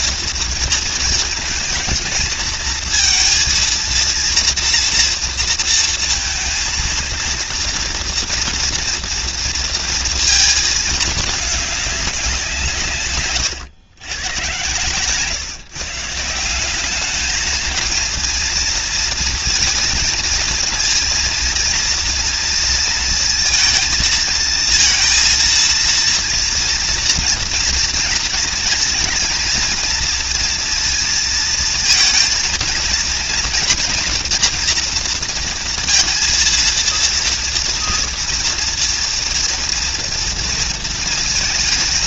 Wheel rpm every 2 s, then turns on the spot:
230, 220, 230, 230, 230, 220, 150, 130, 180, 230, 230, 230, 230, 230, 220, 230, 230, 230, 230, 230, 230.
none